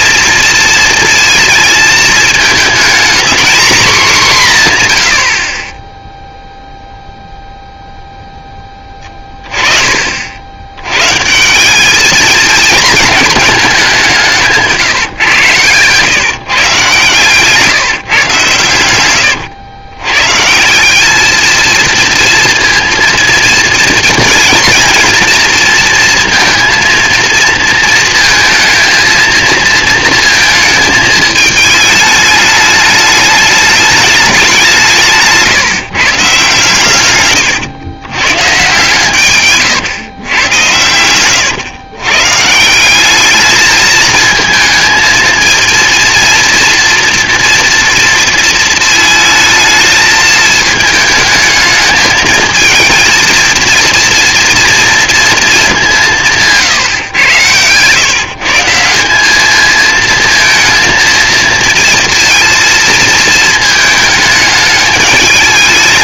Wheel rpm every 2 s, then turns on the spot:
230, 220, 160, 0, 10, 90, 220, 160, 140, 130, 160, 230, 230, 230, 230, 220, 210, 190, 140, 130, 100, 160, 230, 240, 230, 220, 220, 230, 150, 170, 230, 220, 210.
none